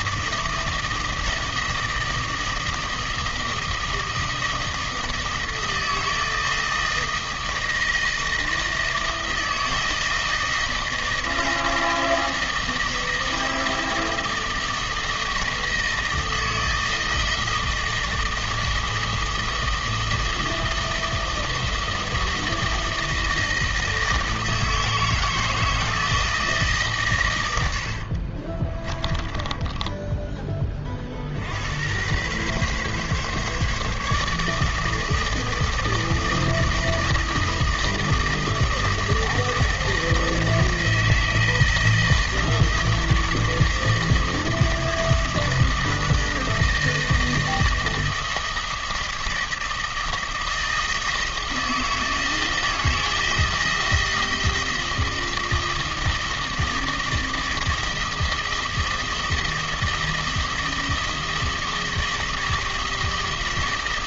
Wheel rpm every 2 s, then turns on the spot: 160, 160, 160, 160, 160, 160, 160, 160, 160, 160, 160, 160, 160, 150, 40, 30, 130, 150, 160, 160, 170, 160, 160, 160, 160, 160, 160, 160, 160, 160, 160, 160.
28-30